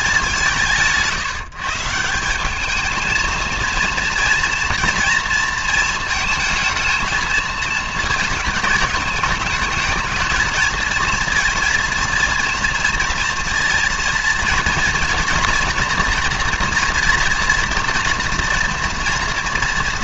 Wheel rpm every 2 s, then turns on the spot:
170, 210, 230, 220, 220, 220, 230, 230, 230, 230.
none